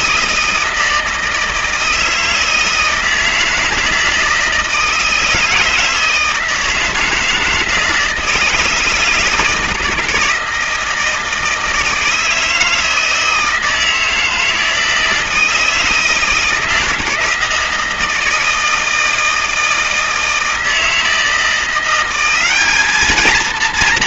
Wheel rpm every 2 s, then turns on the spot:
160, 160, 160, 160, 160, 160, 160, 160, 160, 160, 160, 210.
none